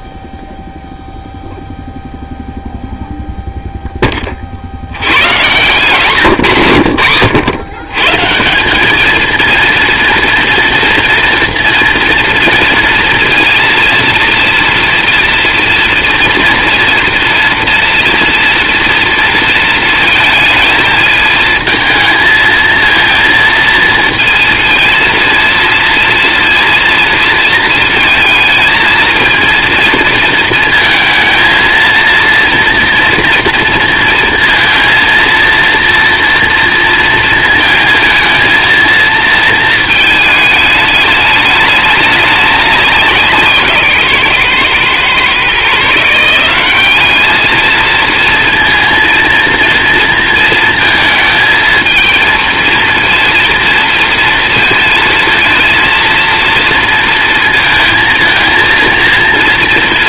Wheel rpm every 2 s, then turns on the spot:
0, 0, 80, 110, 200, 230, 230, 230, 230, 230, 220, 230, 230, 230, 220, 220, 230, 230, 230, 230, 210, 190, 130, 200, 230, 230, 230, 220, 230, 230.
none